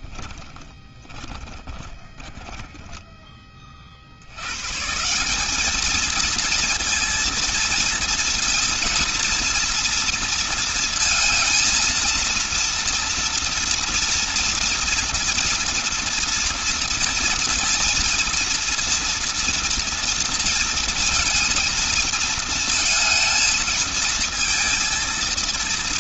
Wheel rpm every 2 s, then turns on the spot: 20, 30, 200, 230, 230, 230, 230, 240, 230, 230, 230, 230, 230.
0-2